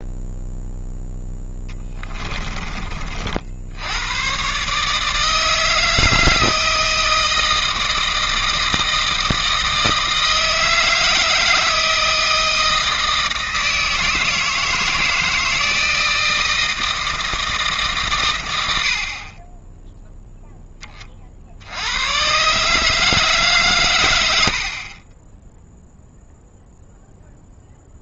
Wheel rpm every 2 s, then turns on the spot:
0, 30, 140, 160, 160, 160, 160, 160, 160, 90, 10, 150, 60, 0.
24-26